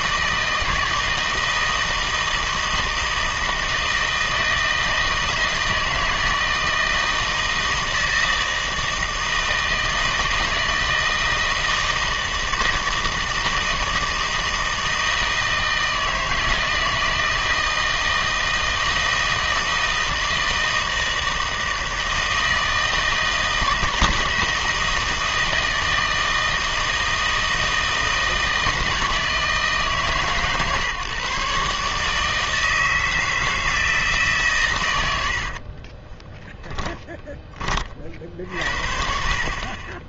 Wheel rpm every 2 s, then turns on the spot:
160, 160, 160, 160, 160, 160, 160, 160, 160, 160, 160, 160, 160, 160, 160, 140, 160, 120, 10, 60.
36-38